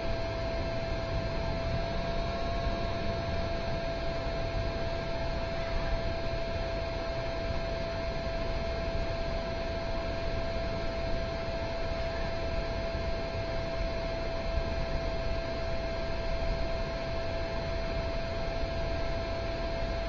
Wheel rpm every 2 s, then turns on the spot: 0, 0, 0, 0, 0, 0, 0, 0, 0, 0.
none